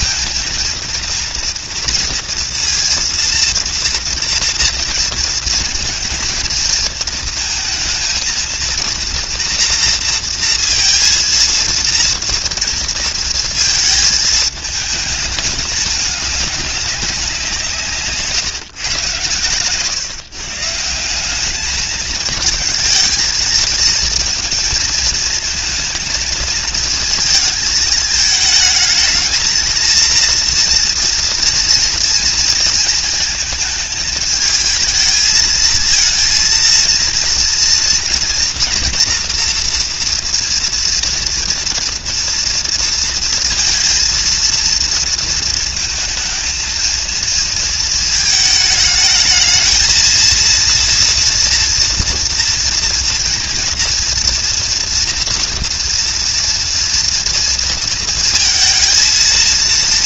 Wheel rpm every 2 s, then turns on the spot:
230, 230, 230, 230, 230, 230, 230, 220, 190, 120, 170, 220, 230, 220, 220, 230, 220, 220, 230, 240, 230, 230, 230, 230, 220, 230, 230, 230, 230, 230.
none